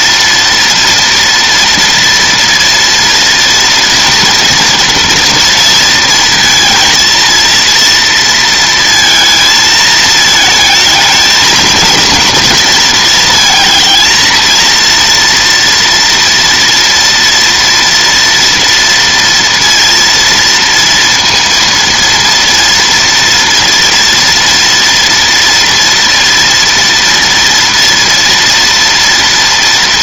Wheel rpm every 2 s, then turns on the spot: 230, 230, 230, 230, 230, 220, 230, 230, 230, 230, 230, 230, 230, 230, 230.
none